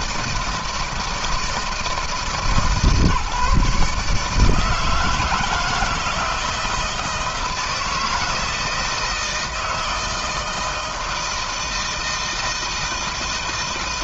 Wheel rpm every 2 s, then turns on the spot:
160, 150, 160, 170, 160, 160, 160.
none